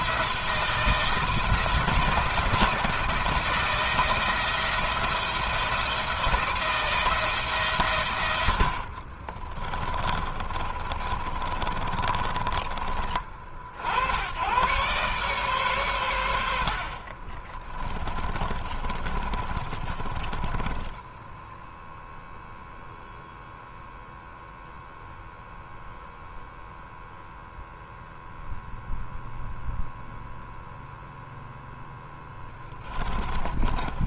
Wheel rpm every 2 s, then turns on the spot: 160, 170, 170, 170, 60, 30, 30, 120, 70, 40, 10, 0, 0, 0, 0, 0, 20.
8-12 16-22 32-34